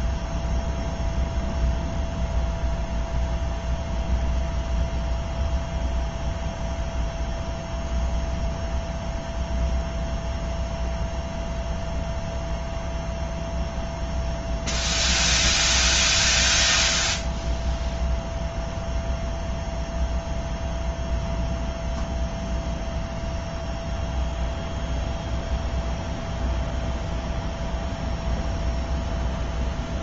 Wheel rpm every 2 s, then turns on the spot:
0, 0, 0, 0, 0, 0, 0, 0, 0, 0, 0, 0, 0, 0, 0.
none